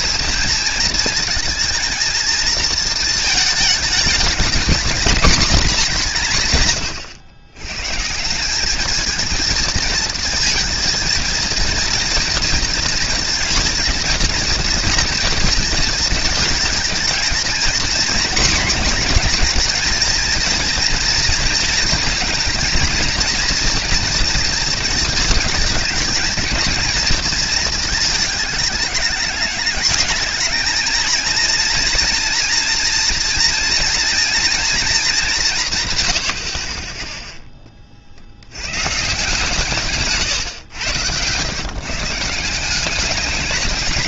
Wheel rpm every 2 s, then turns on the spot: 220, 220, 230, 150, 180, 230, 230, 230, 220, 240, 230, 240, 230, 230, 210, 210, 230, 230, 50, 90, 120, 170.
none